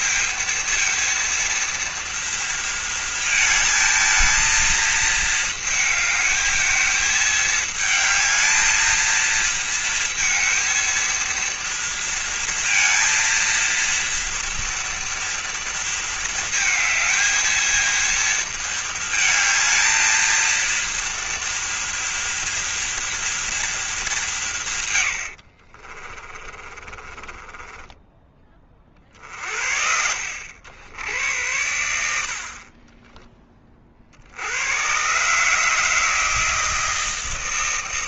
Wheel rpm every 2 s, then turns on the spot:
230, 220, 220, 220, 220, 230, 230, 230, 220, 220, 230, 230, 160, 30, 30, 80, 30, 100, 160.
26-28 32-34